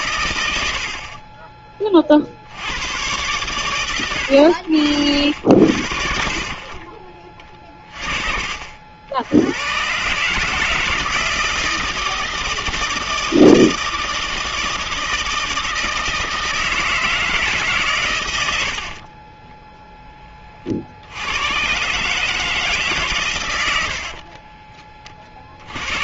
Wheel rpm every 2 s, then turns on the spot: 90, 90, 80, 50, 50, 150, 160, 160, 160, 80, 40, 150, 20.
18-20 24-26